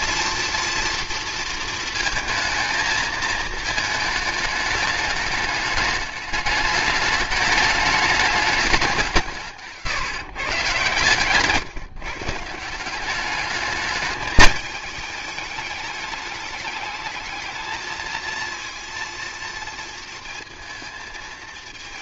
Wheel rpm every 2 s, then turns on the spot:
230, 220, 210, 210, 190, 130, 170, 210, 210, 230, 230.
none